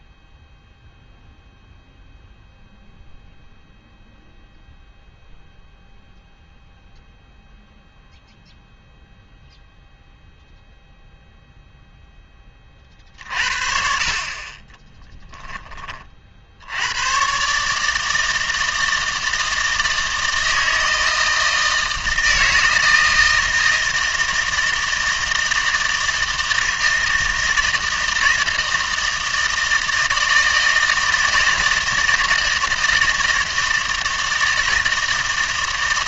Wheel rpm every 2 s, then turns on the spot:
0, 0, 0, 0, 0, 0, 30, 30, 90, 160, 160, 160, 160, 160, 160, 160, 160, 160.
14-16